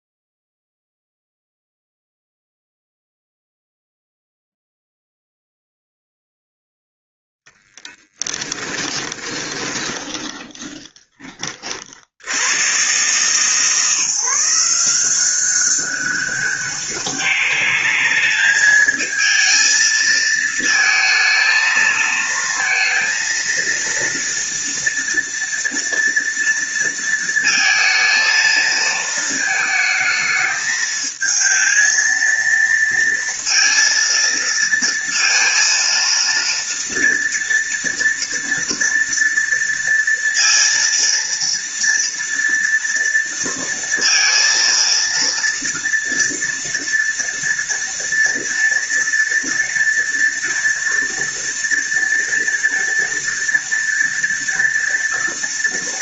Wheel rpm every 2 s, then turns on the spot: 0, 0, 0, 0, 20, 20, 120, 180, 200, 220, 220, 230, 240, 230, 220, 220, 230, 230, 230, 230, 230, 230, 230, 230, 230, 230, 230, 230.
8-12